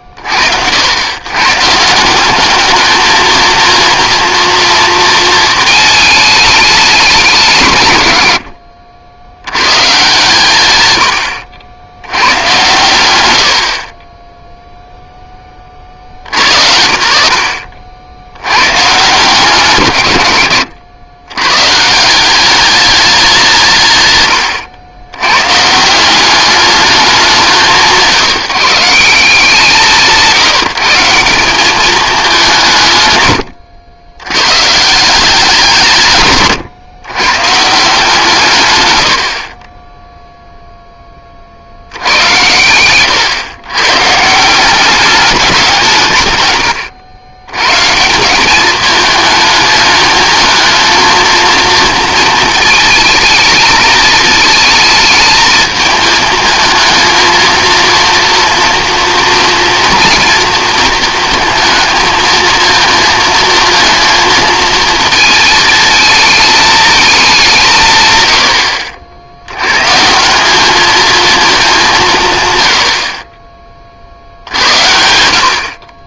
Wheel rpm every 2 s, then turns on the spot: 50, 210, 230, 200, 70, 120, 110, 0, 80, 130, 110, 200, 100, 200, 170, 160, 160, 130, 120, 130, 0, 110, 190, 110, 200, 220, 220, 220, 220, 240, 230, 230, 230, 210, 70, 210, 90, 80.
8-10 20-22 42-44